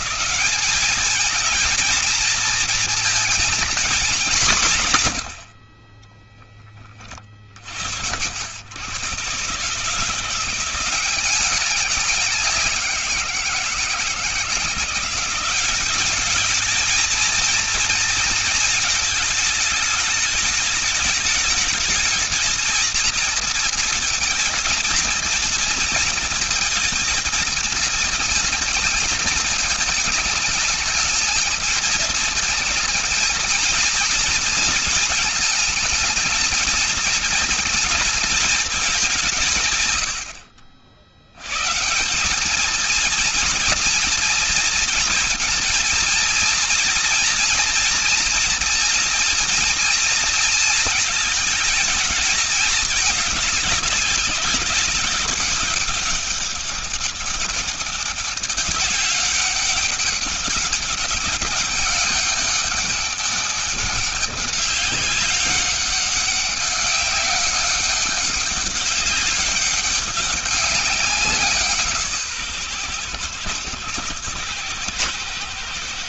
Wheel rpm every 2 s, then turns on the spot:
200, 230, 170, 20, 90, 180, 180, 170, 220, 220, 210, 220, 230, 230, 220, 220, 220, 230, 220, 220, 70, 210, 240, 230, 230, 230, 210, 190, 200, 200, 200, 200, 200, 200, 200, 190, 130, 110.
none